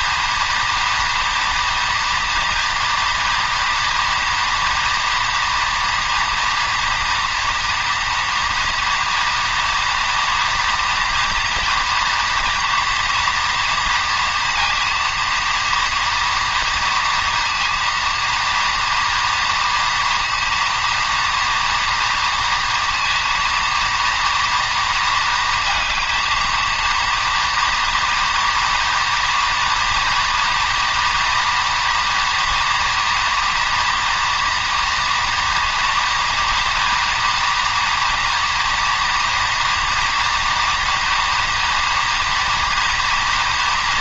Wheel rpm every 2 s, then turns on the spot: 240, 240, 230, 240, 240, 230, 230, 230, 230, 230, 230, 230, 230, 230, 240, 240, 230, 230, 230, 230, 230, 230.
none